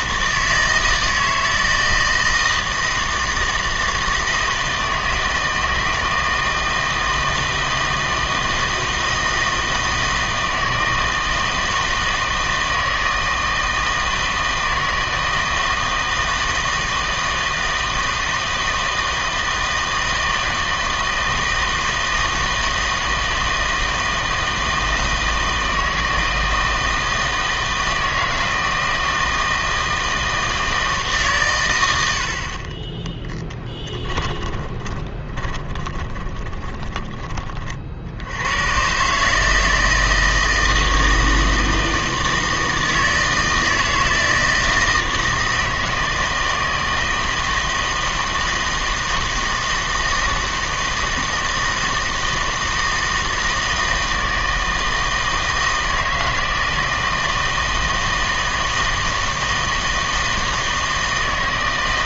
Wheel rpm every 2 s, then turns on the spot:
160, 160, 160, 160, 160, 160, 160, 160, 160, 160, 160, 160, 160, 160, 160, 160, 30, 30, 20, 110, 160, 160, 160, 160, 160, 160, 160, 160, 160, 160, 160.
34-38